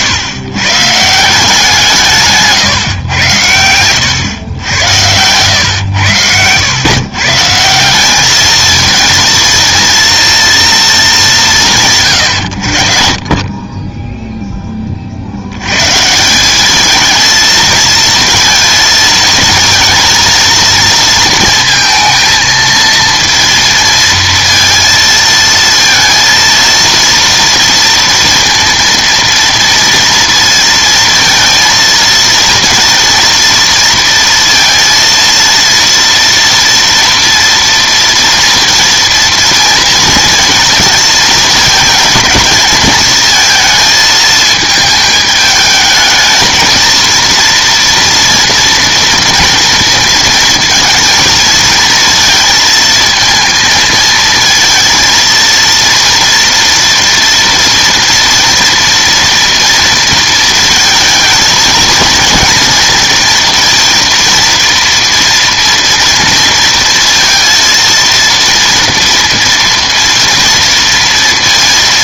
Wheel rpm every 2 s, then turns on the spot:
130, 140, 100, 110, 220, 230, 90, 10, 200, 230, 230, 230, 230, 230, 230, 230, 230, 230, 230, 230, 230, 220, 220, 220, 230, 230, 220, 220, 230, 230, 220, 230, 230, 230, 230, 230.
none